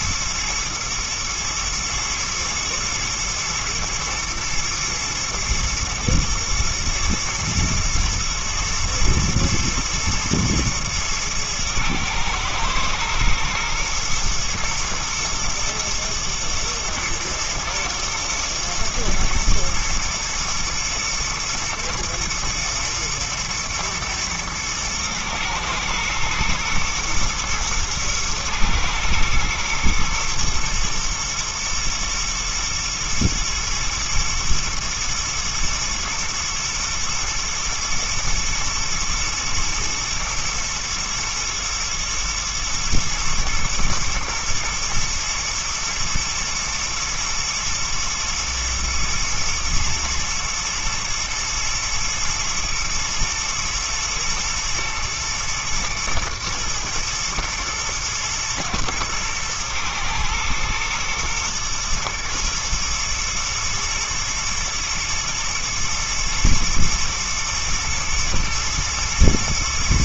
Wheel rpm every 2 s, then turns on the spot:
110, 110, 120, 120, 110, 120, 110, 110, 120, 110, 110, 110, 110, 120, 110, 120, 120, 110, 120, 120, 110, 110, 120, 110, 110, 110, 110, 110, 110, 110, 110, 110, 120, 120, 110.
none